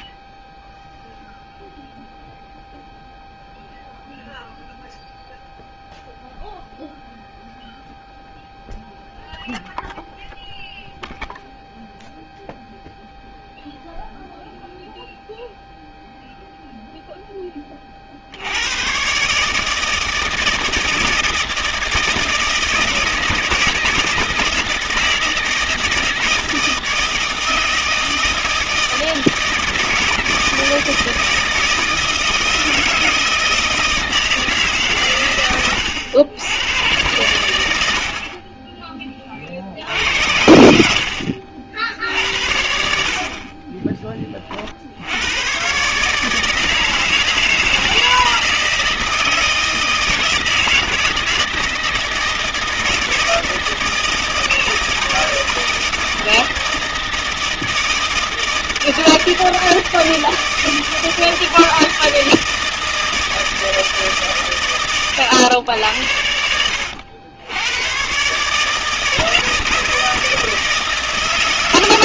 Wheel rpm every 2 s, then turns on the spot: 20, 0, 0, 0, 0, 0, 0, 0, 30, 160, 170, 160, 160, 160, 160, 160, 160, 100, 90, 60, 60, 40, 110, 160, 160, 160, 160, 160, 160, 160, 160, 160, 110, 90, 160, 160.
none